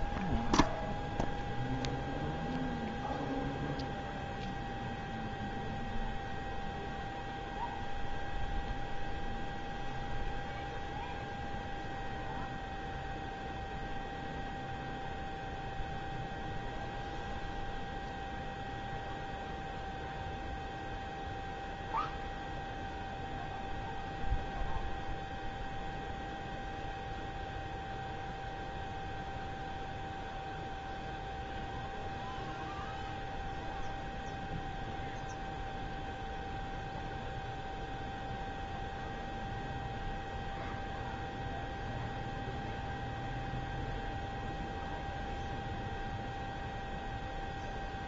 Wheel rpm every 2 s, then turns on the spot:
0, 0, 0, 0, 0, 0, 0, 0, 0, 0, 0, 0, 0, 0, 0, 0, 0, 0, 0, 0, 0, 0, 0, 0.
none